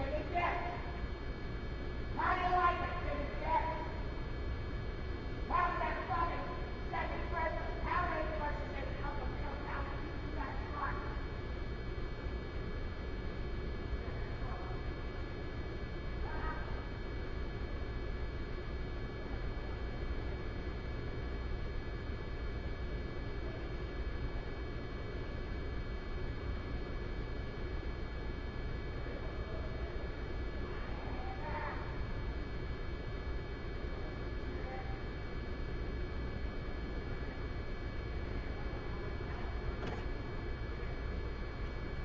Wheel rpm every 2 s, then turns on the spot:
0, 0, 0, 0, 0, 0, 0, 0, 0, 0, 0, 0, 0, 0, 0, 0, 0, 0, 0, 0, 0.
none